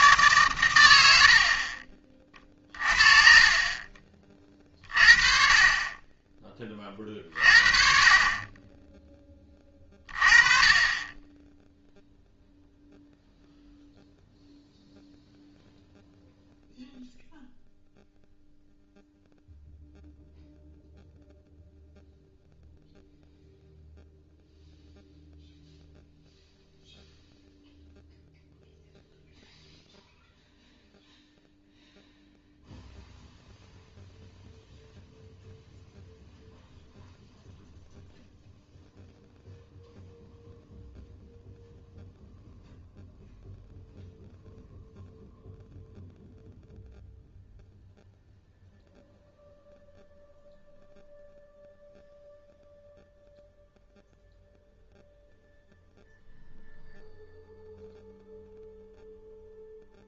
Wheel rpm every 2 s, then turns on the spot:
110, 40, 30, 30, 20, 30, 0, 0, 0, 0, 0, 0, 0, 0, 0, 0, 0, 0, 0, 0, 0, 0, 0, 0, 0, 0, 0, 0, 0, 0.
2-4